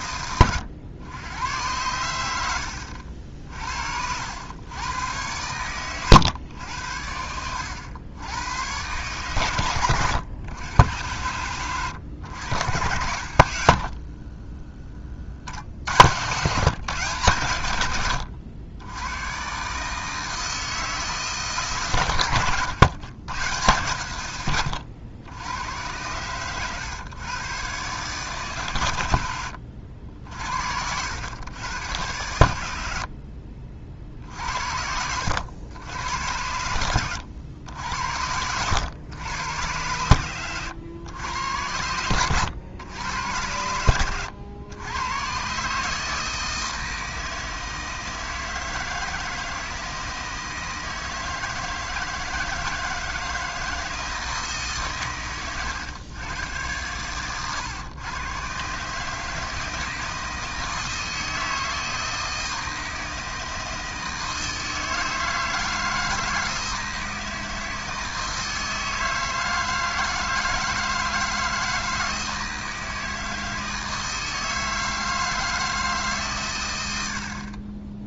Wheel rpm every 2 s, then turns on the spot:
110, 70, 100, 90, 120, 100, 80, 30, 140, 100, 160, 120, 90, 120, 110, 80, 70, 70, 90, 100, 110, 100, 100, 160, 160, 160, 160, 130, 110, 150, 160, 160, 160, 160, 160, 160, 160, 160, 80.
2-4 32-34